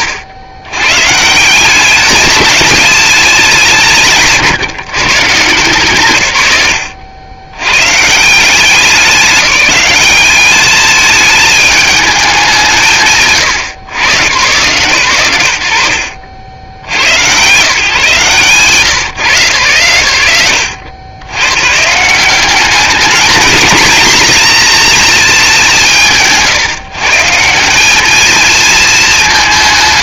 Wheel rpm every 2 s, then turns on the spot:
100, 210, 150, 100, 190, 210, 170, 120, 90, 150, 80, 210, 230, 140, 220.
18-20